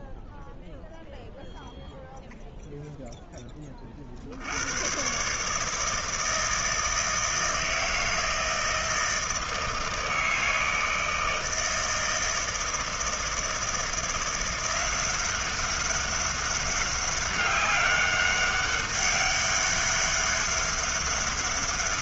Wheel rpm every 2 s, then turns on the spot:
0, 10, 150, 160, 160, 160, 160, 190, 200, 200, 200.
none